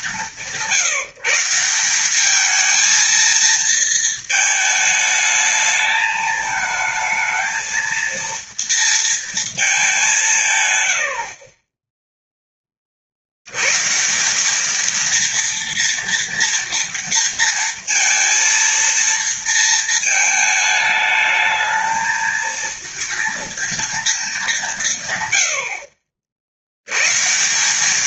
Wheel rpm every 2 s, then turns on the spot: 170, 220, 220, 220, 230, 130, 20, 210, 230, 230, 210, 230, 170, 80.
none